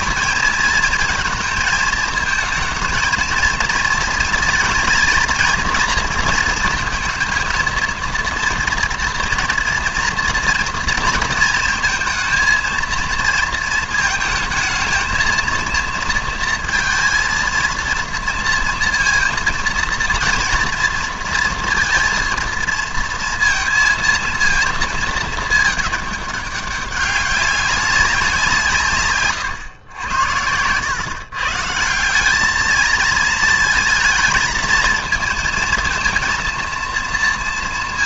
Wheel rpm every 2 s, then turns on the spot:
230, 230, 230, 230, 230, 230, 230, 230, 230, 230, 230, 230, 230, 200, 150, 100, 220, 220, 230.
30-32